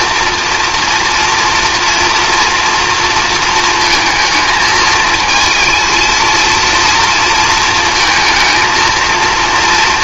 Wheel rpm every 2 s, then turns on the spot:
230, 230, 220, 230, 230.
none